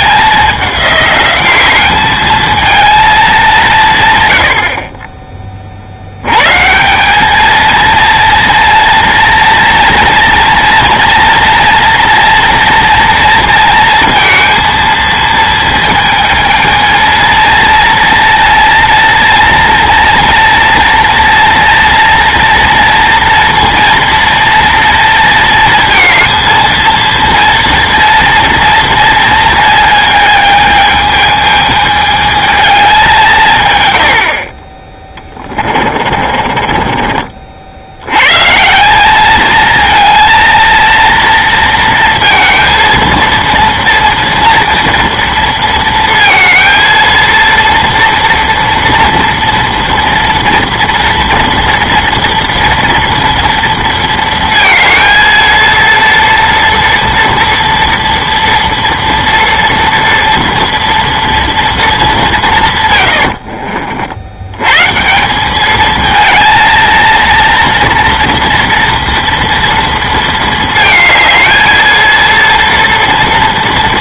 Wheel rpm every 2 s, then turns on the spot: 200, 220, 60, 140, 230, 240, 230, 230, 220, 230, 230, 230, 230, 230, 230, 220, 210, 30, 40, 160, 220, 230, 230, 230, 230, 230, 230, 230, 230, 230, 240, 130, 120, 230, 230, 220, 230.
36-38